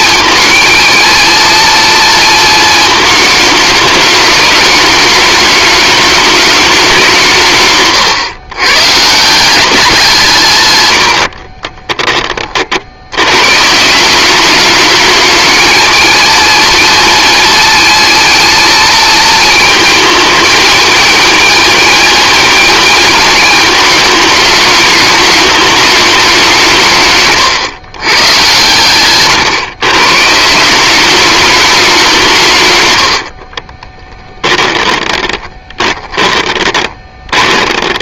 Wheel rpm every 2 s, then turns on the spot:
220, 220, 210, 180, 130, 100, 80, 220, 230, 230, 230, 230, 210, 170, 120, 190, 110, 30, 20.
10-12 34-38